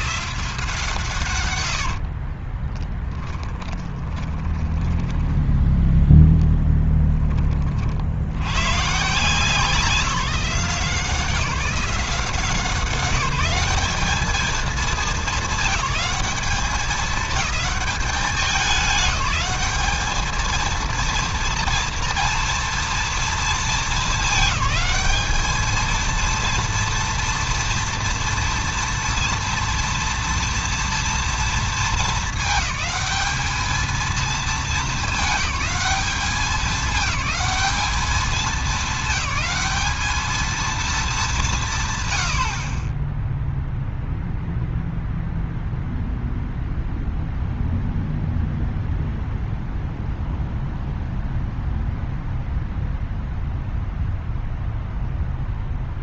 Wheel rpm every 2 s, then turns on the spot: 150, 20, 10, 10, 130, 180, 180, 220, 210, 190, 220, 230, 200, 230, 230, 230, 210, 210, 200, 200, 220, 50, 0, 0, 0, 0, 0, 0.
2-6